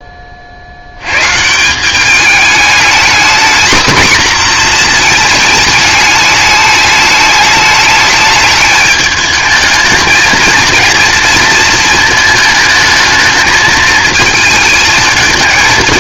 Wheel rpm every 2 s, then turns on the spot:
50, 220, 240, 210, 210, 230, 220, 220.
none